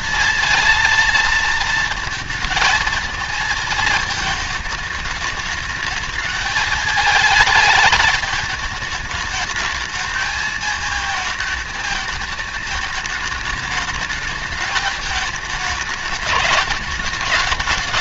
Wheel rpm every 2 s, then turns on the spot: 230, 220, 220, 210, 210, 220, 220, 220, 210.
none